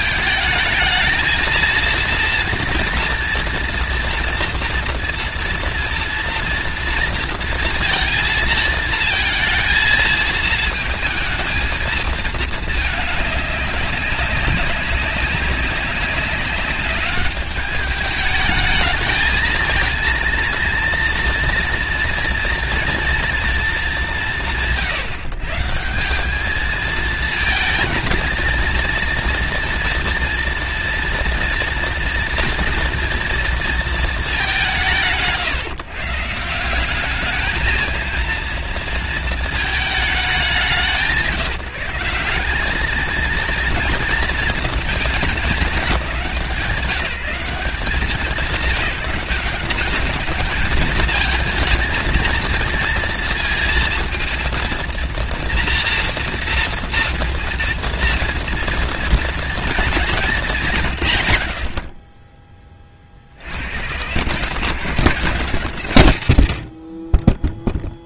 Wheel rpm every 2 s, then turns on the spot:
220, 230, 230, 230, 220, 220, 210, 190, 190, 210, 230, 230, 120, 210, 230, 240, 230, 190, 180, 230, 190, 200, 220, 170, 190, 220, 230, 230, 240, 230, 170, 20, 150, 50.
none